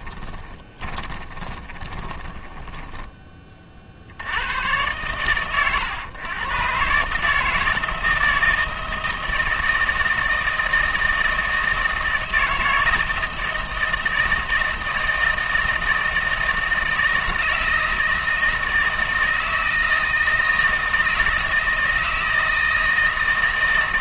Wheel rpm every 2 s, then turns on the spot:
20, 10, 100, 130, 160, 160, 160, 160, 160, 160, 160, 160.
0-4